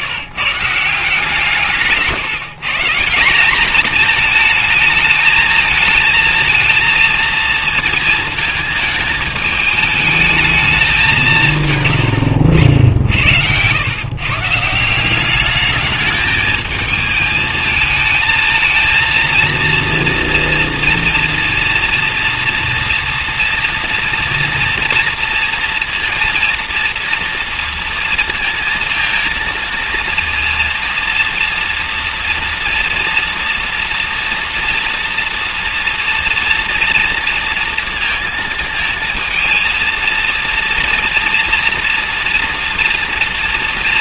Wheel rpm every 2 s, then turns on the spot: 160, 160, 220, 220, 220, 210, 70, 160, 220, 230, 230, 230, 230, 230, 230, 230, 230, 230, 230, 230, 230, 230.
none